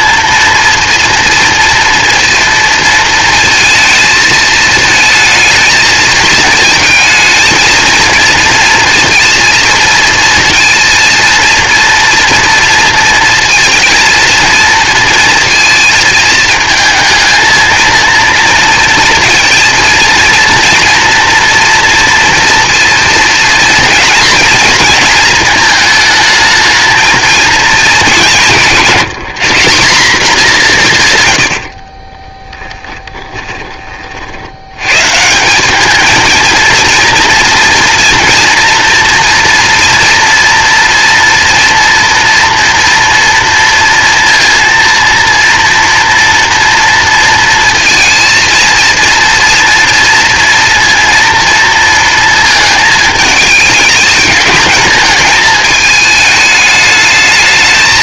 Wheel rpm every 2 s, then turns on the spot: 240, 230, 220, 220, 230, 230, 230, 230, 220, 230, 230, 230, 230, 220, 180, 190, 10, 90, 230, 230, 230, 240, 230, 230, 230, 240, 220, 210, 210.
32-34